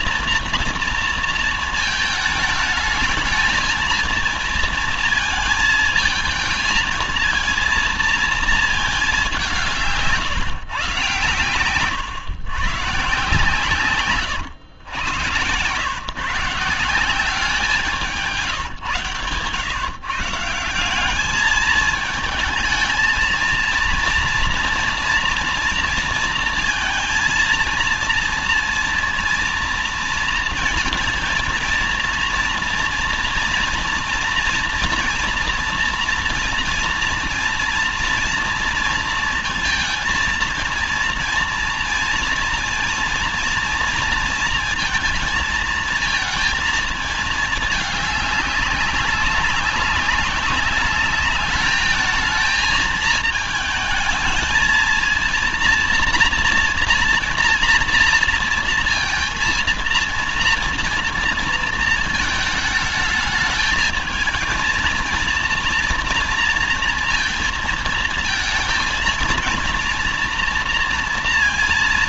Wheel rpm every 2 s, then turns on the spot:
230, 210, 220, 230, 210, 130, 140, 120, 170, 140, 190, 220, 230, 230, 230, 230, 230, 230, 230, 230, 230, 230, 230, 230, 200, 200, 220, 220, 230, 230, 230, 220, 230, 230, 230, 240.
none